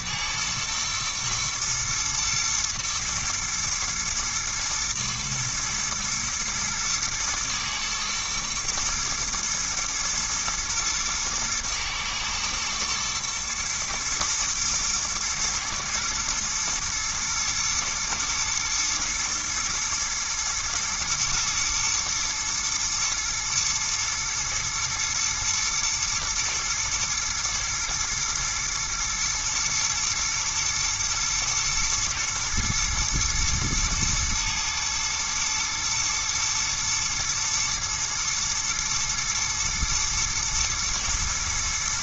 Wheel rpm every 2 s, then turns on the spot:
110, 110, 110, 110, 110, 120, 110, 110, 120, 110, 110, 120, 120, 110, 110, 120, 120, 110, 110, 110, 110.
none